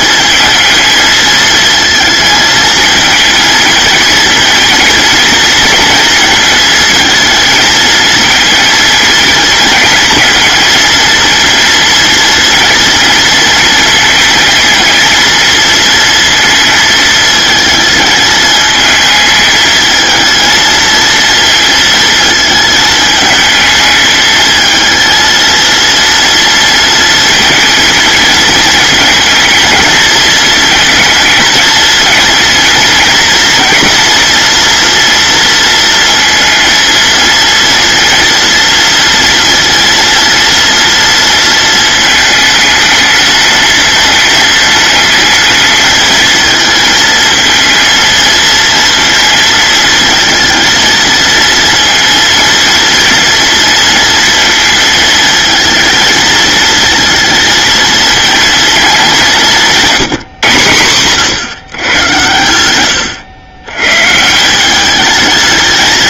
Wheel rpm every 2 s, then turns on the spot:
220, 220, 230, 220, 230, 230, 230, 230, 230, 220, 230, 220, 220, 230, 220, 220, 230, 240, 230, 230, 230, 220, 220, 230, 230, 220, 230, 220, 220, 220, 140, 100, 200.
none